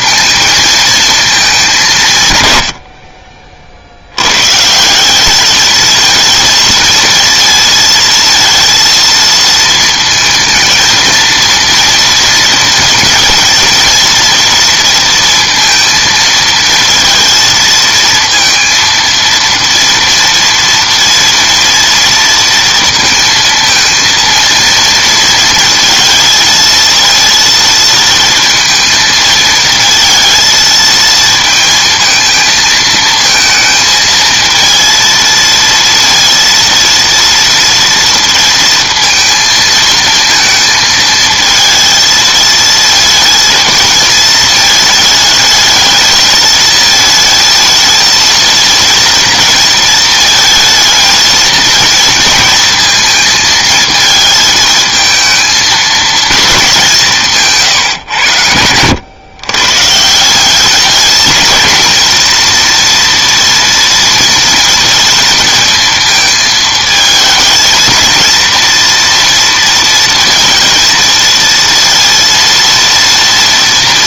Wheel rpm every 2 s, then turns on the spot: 220, 60, 190, 230, 230, 230, 230, 230, 230, 230, 230, 230, 230, 230, 220, 220, 220, 230, 230, 230, 220, 230, 220, 220, 230, 230, 230, 220, 170, 110, 220, 230, 230, 220, 230, 230, 230.
none